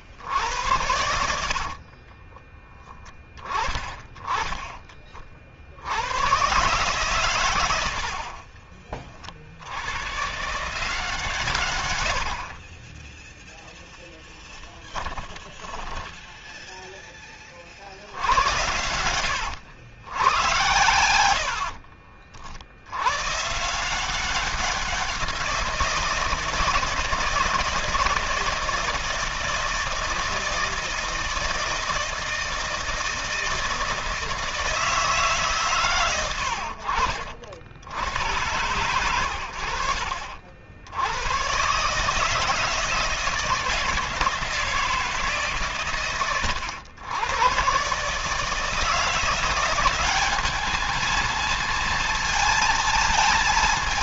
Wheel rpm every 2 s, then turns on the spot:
80, 10, 40, 140, 40, 160, 20, 10, 10, 90, 100, 90, 180, 160, 160, 160, 160, 160, 60, 100, 90, 160, 160, 100, 170, 220, 220.
0-2 14-16 20-22